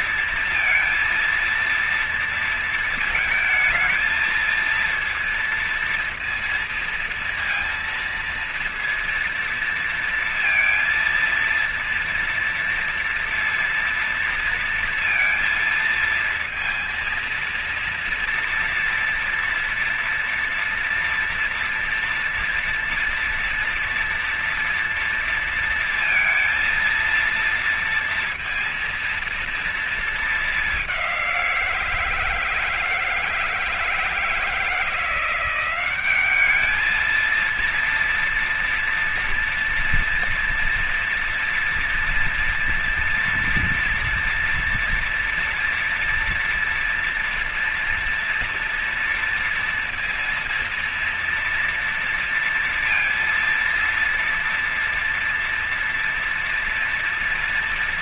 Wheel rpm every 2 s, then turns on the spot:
230, 230, 220, 230, 230, 230, 230, 230, 230, 230, 230, 230, 230, 230, 230, 190, 160, 170, 220, 230, 230, 230, 230, 230, 230, 230, 230, 230, 230.
none